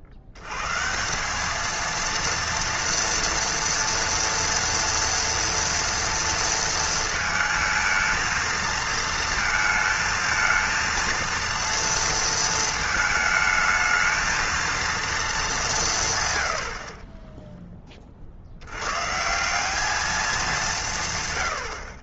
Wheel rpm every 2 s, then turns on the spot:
80, 230, 230, 230, 230, 230, 220, 230, 70, 80, 180.
none